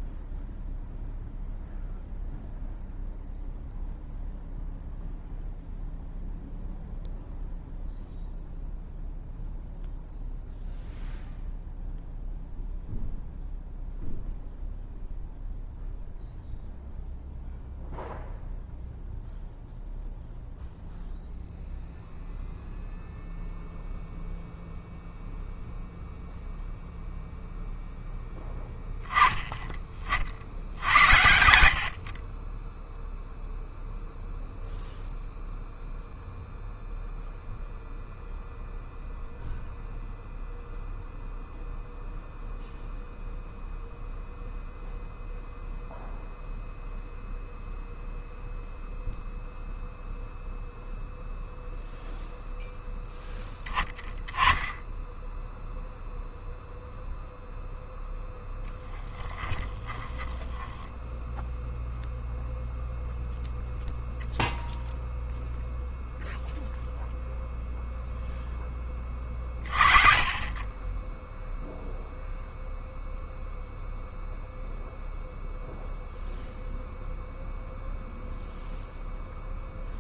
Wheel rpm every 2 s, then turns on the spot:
0, 0, 0, 0, 0, 0, 0, 0, 0, 0, 0, 0, 0, 0, 10, 80, 10, 0, 0, 0, 0, 0, 0, 0, 0, 0, 0, 10, 0, 0, 20, 0, 0, 0, 10, 20, 0, 0, 0, 0.
60-62